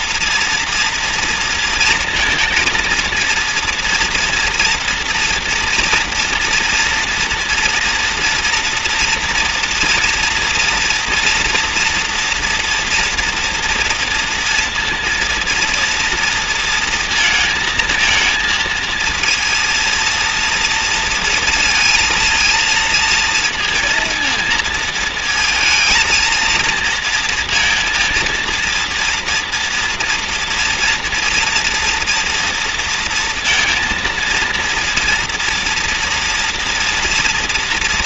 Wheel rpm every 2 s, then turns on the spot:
230, 230, 230, 230, 230, 230, 230, 230, 230, 220, 230, 230, 230, 230, 230, 230, 230, 230, 240.
none